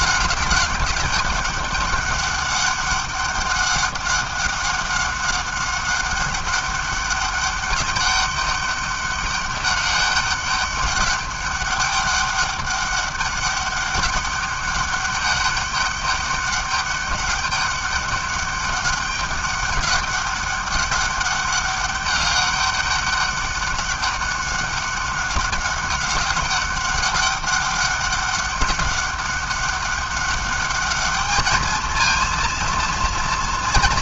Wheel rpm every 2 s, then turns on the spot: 180, 200, 200, 200, 200, 200, 200, 200, 200, 200, 200, 200, 200, 200, 200, 200, 220.
none